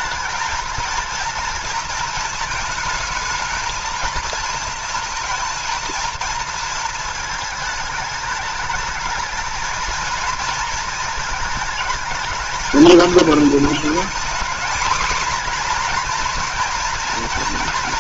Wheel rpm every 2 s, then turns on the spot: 230, 220, 230, 230, 220, 220, 220, 240, 240.
none